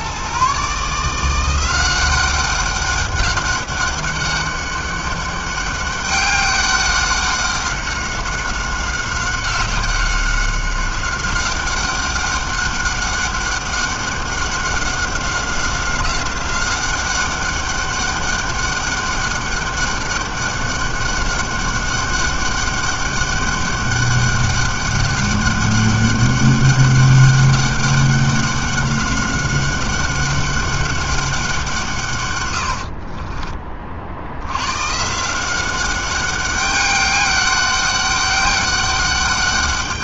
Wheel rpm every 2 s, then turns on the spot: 140, 190, 200, 200, 190, 190, 200, 190, 190, 200, 200, 200, 200, 200, 190, 200, 100, 100, 200, 200.
none